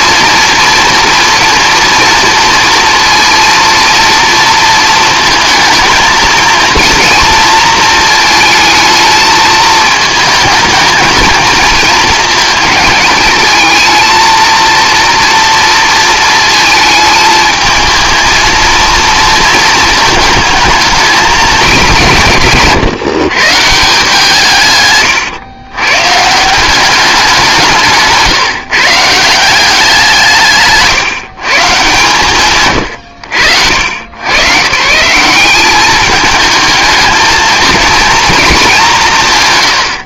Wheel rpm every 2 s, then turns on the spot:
240, 230, 230, 230, 220, 220, 220, 230, 220, 230, 220, 150, 140, 190, 150, 140, 120, 150, 220, 210.
none